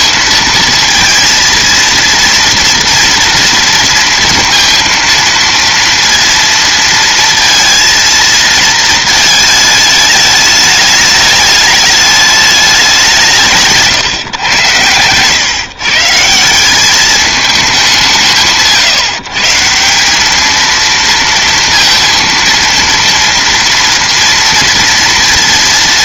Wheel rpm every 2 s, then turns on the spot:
230, 230, 230, 230, 220, 210, 200, 110, 190, 150, 230, 230, 230.
none